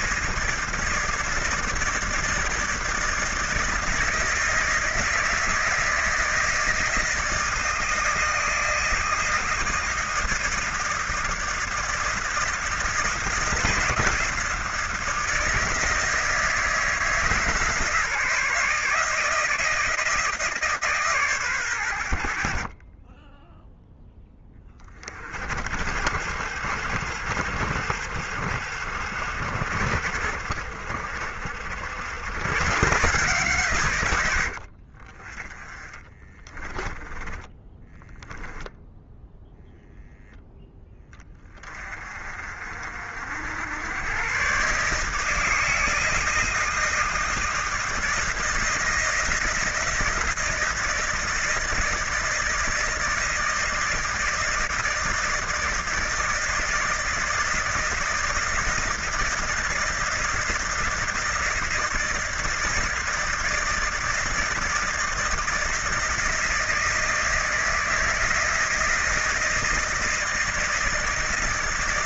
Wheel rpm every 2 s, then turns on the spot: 160, 160, 160, 160, 160, 160, 160, 160, 160, 160, 140, 30, 20, 70, 70, 60, 130, 50, 20, 0, 20, 60, 140, 160, 170, 170, 160, 160, 160, 160, 160, 160, 160, 160, 160, 160.
36-38